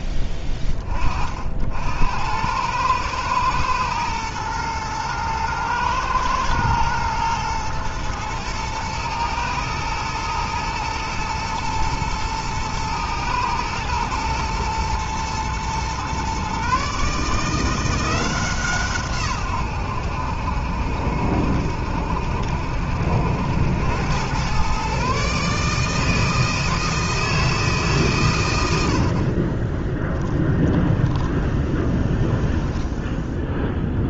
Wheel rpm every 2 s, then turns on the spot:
30, 100, 110, 110, 110, 110, 110, 120, 140, 150, 70, 70, 130, 160, 80, 10, 10.
30-34